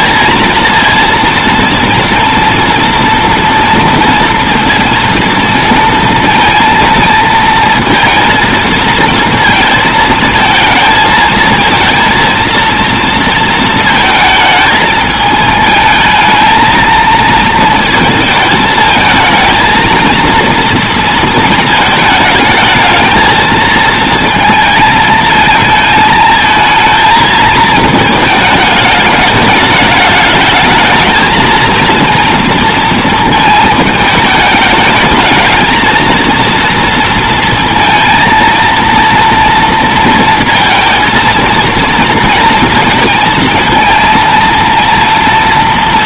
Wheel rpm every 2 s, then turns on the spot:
230, 230, 230, 230, 230, 220, 230, 220, 220, 220, 230, 220, 220, 220, 220, 220, 230, 210, 230, 230, 230, 220, 230.
none